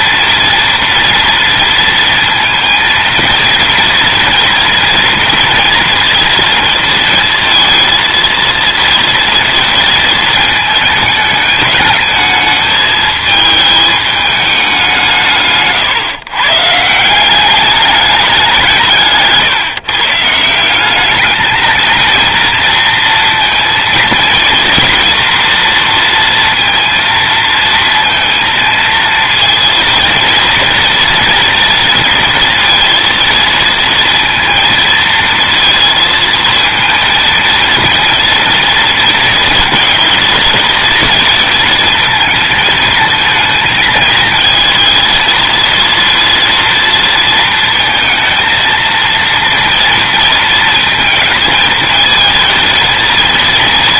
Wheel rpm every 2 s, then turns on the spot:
230, 230, 240, 230, 230, 220, 210, 190, 150, 160, 190, 230, 230, 230, 230, 230, 230, 220, 230, 230, 220, 220, 230, 230, 230, 220, 230.
none